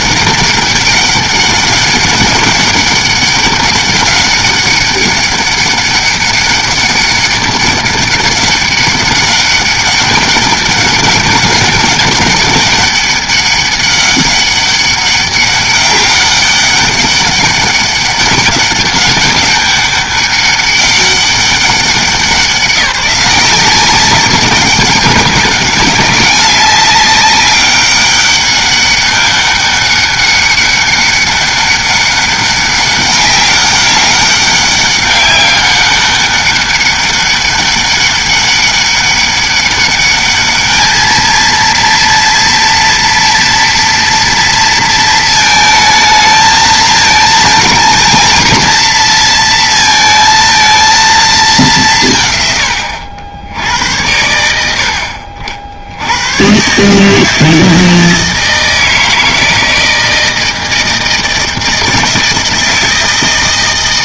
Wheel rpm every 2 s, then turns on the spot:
200, 200, 200, 200, 200, 200, 200, 200, 200, 200, 200, 190, 200, 190, 200, 200, 200, 200, 200, 200, 210, 230, 230, 220, 230, 230, 110, 80, 130, 160, 160, 160.
none